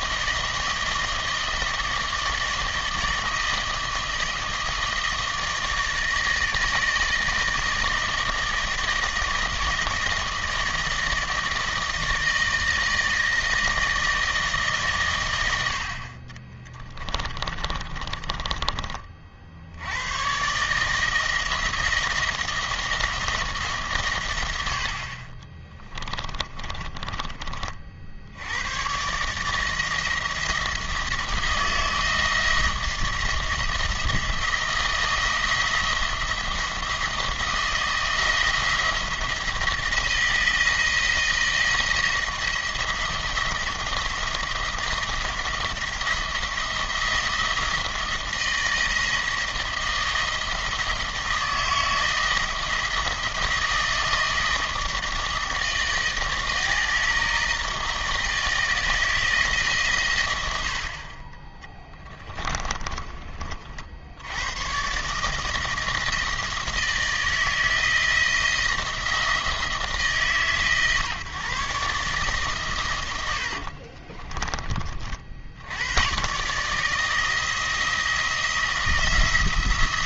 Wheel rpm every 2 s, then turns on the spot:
160, 160, 160, 160, 160, 160, 160, 150, 30, 30, 140, 170, 90, 20, 90, 160, 170, 170, 170, 170, 170, 170, 170, 170, 160, 160, 160, 160, 160, 160, 80, 20, 110, 160, 160, 140, 130, 30, 150, 170.
16-20 26-28 62-64